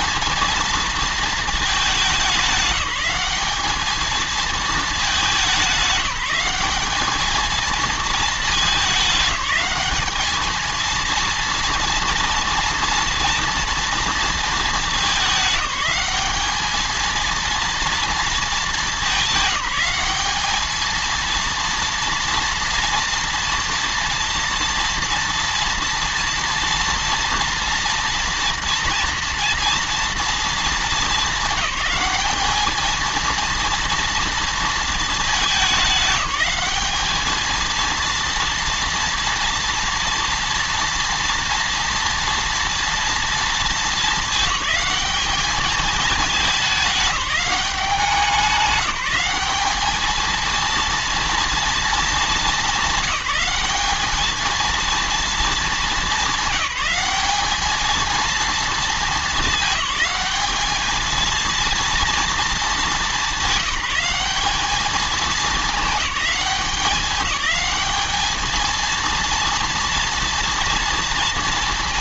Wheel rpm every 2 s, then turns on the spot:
230, 190, 220, 190, 220, 220, 230, 220, 210, 220, 210, 230, 230, 230, 230, 220, 200, 220, 200, 230, 230, 230, 220, 210, 190, 230, 210, 220, 200, 220, 210, 220, 210, 200, 220, 230.
none